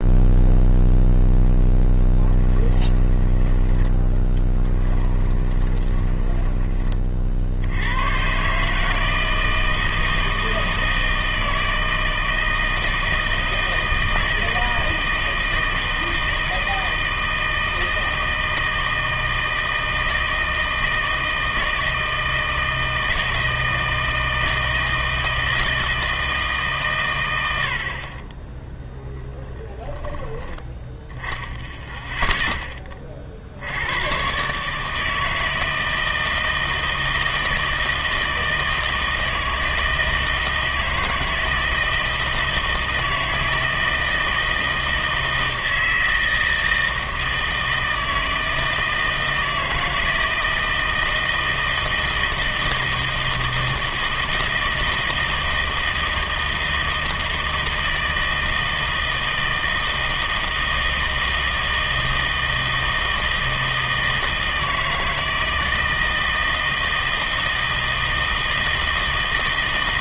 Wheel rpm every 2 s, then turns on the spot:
0, 20, 20, 20, 150, 160, 160, 160, 160, 160, 160, 160, 160, 140, 10, 10, 20, 150, 160, 160, 160, 160, 160, 160, 160, 160, 160, 160, 160, 160, 160, 160, 160, 160, 160.
2-6